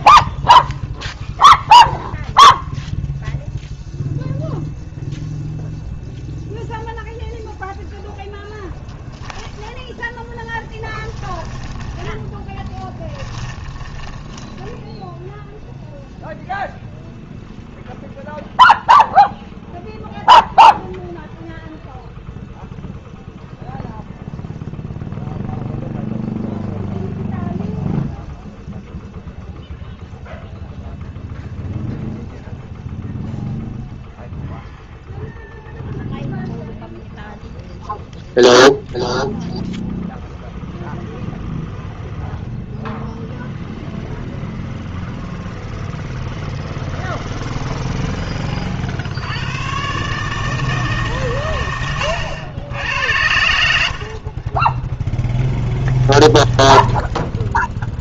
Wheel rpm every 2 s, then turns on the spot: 0, 0, 0, 0, 10, 20, 10, 0, 0, 0, 0, 0, 0, 0, 0, 0, 0, 0, 0, 0, 0, 0, 0, 0, 80, 140, 80, 10, 10.
10-14 52-58